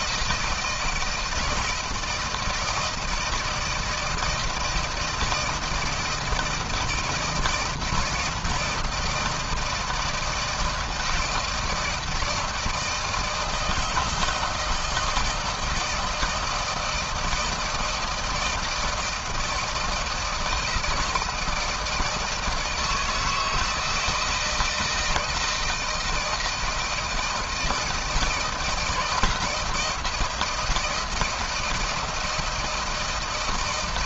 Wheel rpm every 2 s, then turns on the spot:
160, 160, 160, 160, 160, 160, 160, 160, 160, 160, 160, 160, 160, 160, 160, 170, 160.
none